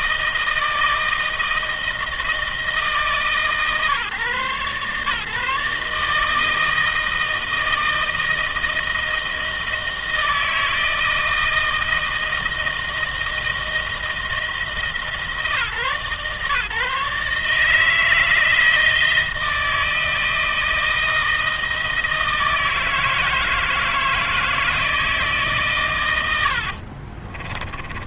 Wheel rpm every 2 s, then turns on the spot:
160, 160, 140, 160, 160, 160, 160, 160, 150, 160, 160, 160, 160, 70.
26-28